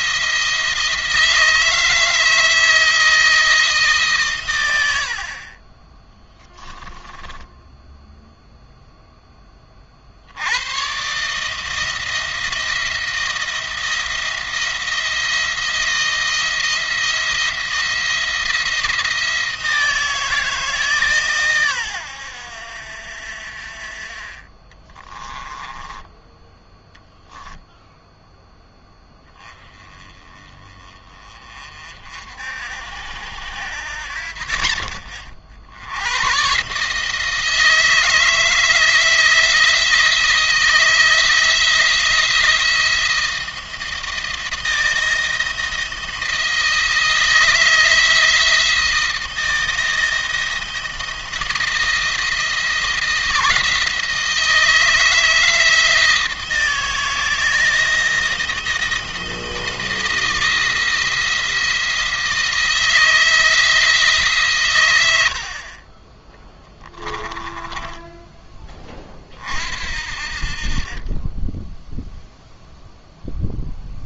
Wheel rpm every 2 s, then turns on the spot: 160, 160, 90, 10, 0, 110, 170, 170, 170, 170, 150, 70, 20, 10, 10, 30, 70, 40, 140, 160, 170, 170, 170, 160, 160, 170, 160, 160, 160, 160, 170, 170, 120, 10, 20, 40, 0.
4-8 24-26 66-68